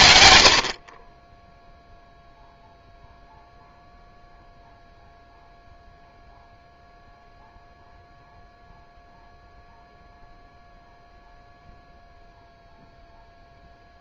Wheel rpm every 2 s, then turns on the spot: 50, 0, 0, 0, 0, 0, 0.
none